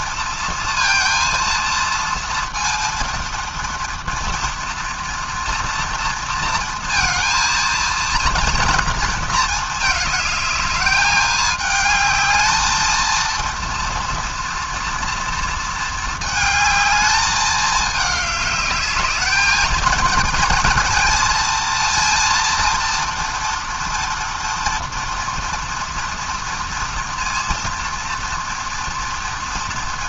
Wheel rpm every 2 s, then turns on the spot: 230, 230, 230, 230, 230, 210, 220, 230, 220, 210, 230, 230, 230, 230, 240.
none